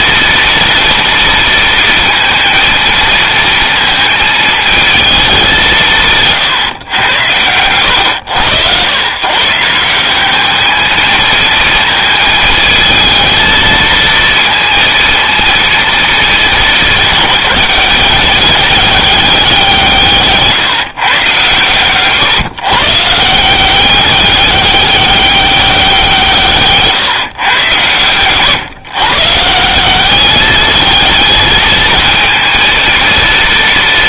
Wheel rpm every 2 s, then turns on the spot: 230, 230, 220, 130, 110, 210, 220, 230, 200, 200, 150, 140, 200, 160, 130, 210, 220.
none